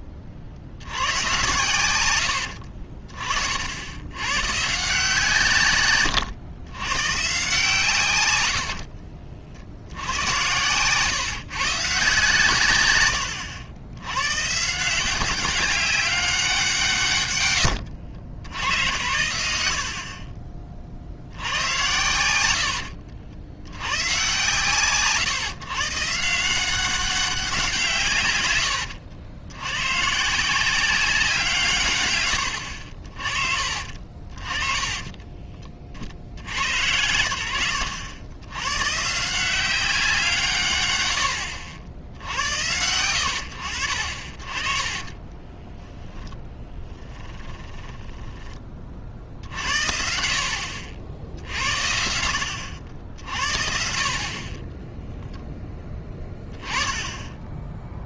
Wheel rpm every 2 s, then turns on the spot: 50, 70, 140, 110, 70, 110, 120, 150, 170, 80, 40, 80, 130, 190, 100, 170, 70, 30, 80, 110, 140, 80, 30, 10, 30, 50, 80, 20, 20.
2-4 8-12 22-24 46-48 54-56